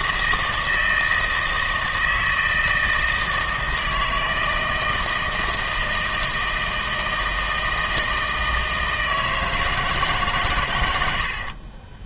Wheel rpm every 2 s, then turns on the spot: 160, 160, 160, 160, 160, 110.
none